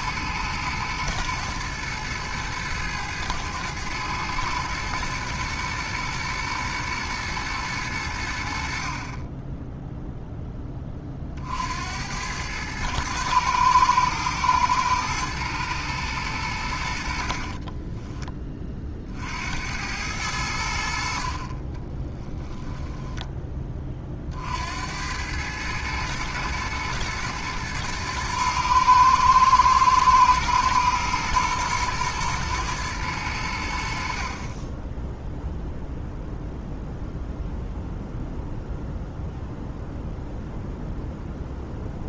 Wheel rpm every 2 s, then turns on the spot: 110, 110, 110, 120, 60, 10, 100, 110, 90, 30, 80, 10, 70, 120, 120, 120, 110, 20, 0, 0, 0.
22-24